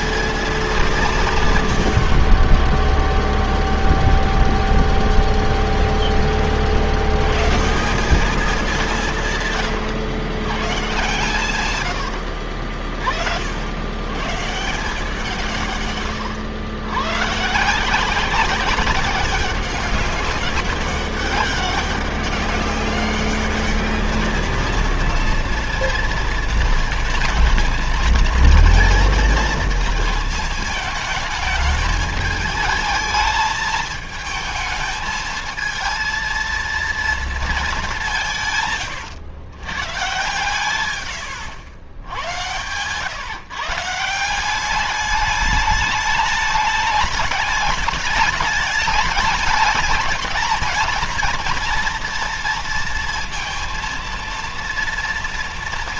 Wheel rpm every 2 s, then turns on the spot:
190, 10, 0, 80, 180, 130, 60, 160, 120, 190, 190, 200, 230, 230, 230, 220, 220, 220, 230, 130, 110, 110, 200, 210, 200, 230, 230, 230.
2-4 40-42